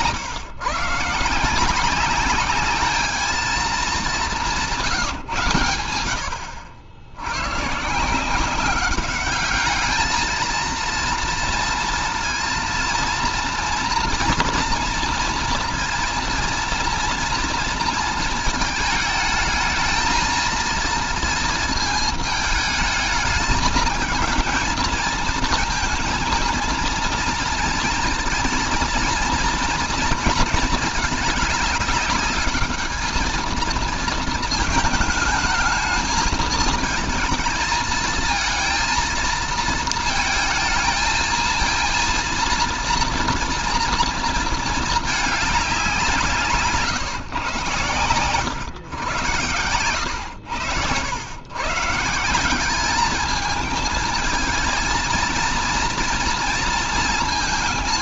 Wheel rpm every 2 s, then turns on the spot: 140, 210, 170, 80, 190, 230, 230, 240, 230, 220, 230, 220, 220, 230, 230, 220, 210, 220, 220, 230, 230, 240, 230, 140, 100, 90, 190, 220, 230.
none